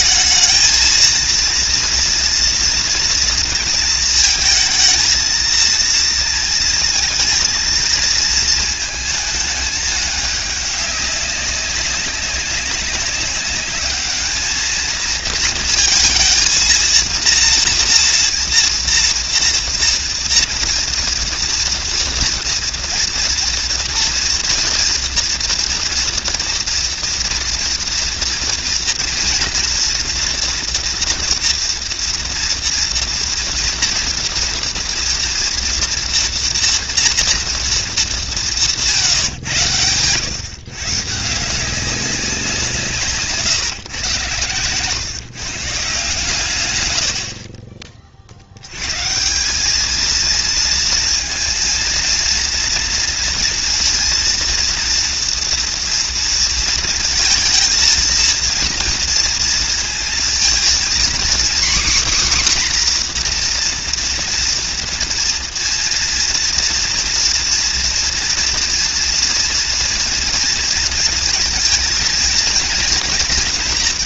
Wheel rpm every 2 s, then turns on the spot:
230, 230, 230, 230, 220, 200, 200, 220, 230, 230, 230, 230, 230, 230, 230, 230, 230, 230, 230, 160, 150, 160, 130, 90, 140, 230, 230, 230, 220, 230, 250, 260, 230, 230, 230, 230, 230.
46-48